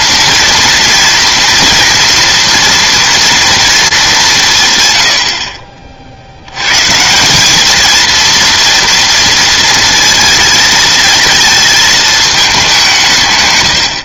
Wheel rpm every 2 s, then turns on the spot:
230, 230, 140, 140, 230, 230, 190.
none